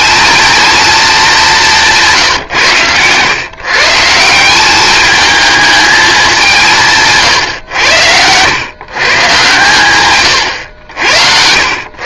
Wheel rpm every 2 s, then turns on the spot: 220, 110, 200, 160, 110, 100.
10-12